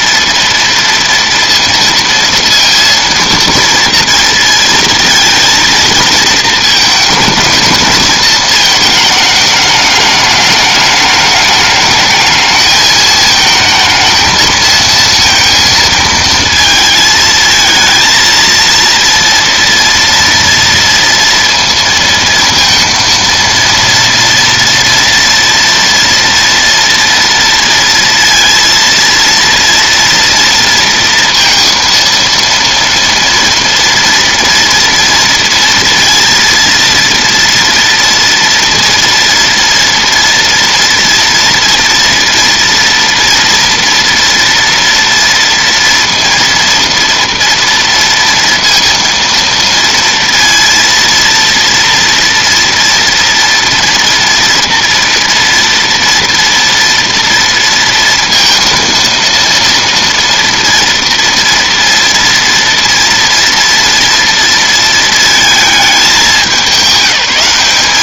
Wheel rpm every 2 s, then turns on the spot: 230, 230, 230, 220, 220, 210, 220, 230, 220, 230, 230, 230, 230, 230, 230, 230, 230, 230, 230, 230, 240, 230, 230, 230, 230, 230, 230, 230, 230, 230, 230, 230, 230, 200.
none